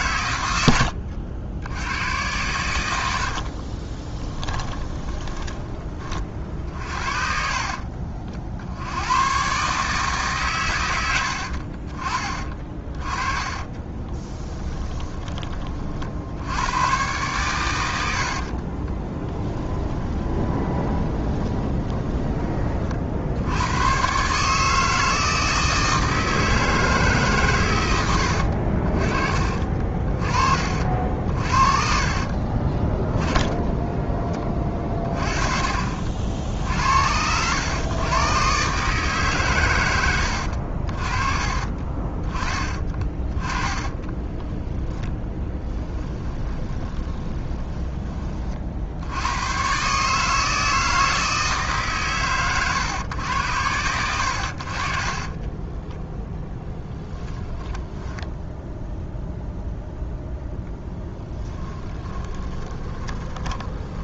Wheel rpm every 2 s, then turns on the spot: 80, 100, 10, 50, 90, 110, 30, 10, 110, 30, 20, 40, 160, 150, 40, 50, 20, 30, 70, 140, 40, 20, 10, 20, 70, 160, 120, 40, 10, 0, 20, 20.
0-2 4-8 12-16 18-22 42-48 56-58 60-64